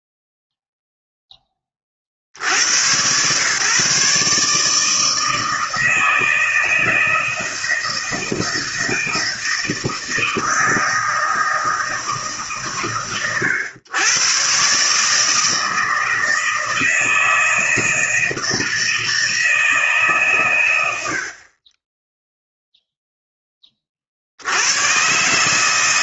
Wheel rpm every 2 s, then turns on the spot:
0, 80, 150, 160, 160, 160, 130, 130, 160, 160, 120, 0, 80.
none